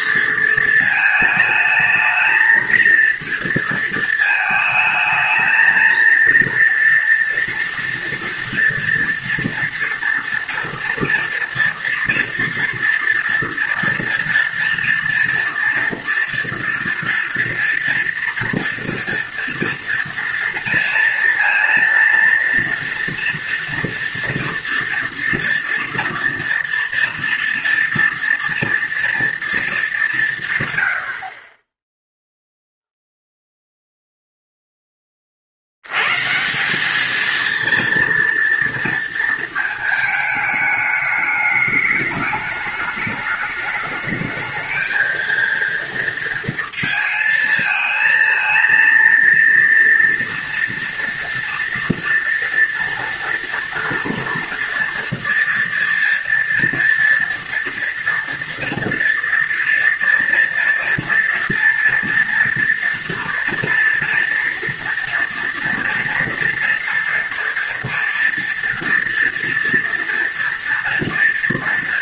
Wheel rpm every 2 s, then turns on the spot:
220, 220, 220, 230, 230, 230, 240, 230, 230, 230, 230, 230, 230, 230, 230, 130, 0, 0, 170, 230, 210, 210, 220, 230, 230, 240, 230, 230, 240, 230, 230, 230, 230, 230, 230, 230.
none